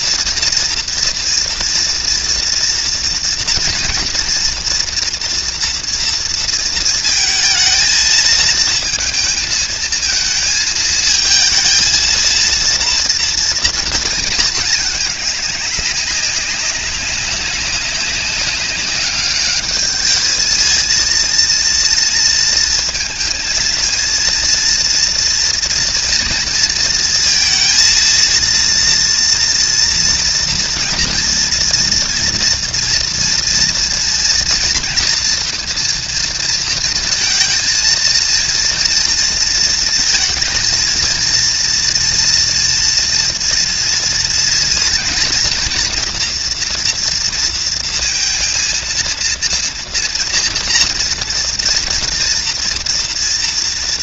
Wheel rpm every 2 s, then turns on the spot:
230, 230, 230, 230, 220, 220, 230, 220, 200, 200, 220, 230, 230, 230, 230, 230, 230, 230, 230, 230, 230, 230, 230, 240, 230, 230, 230.
none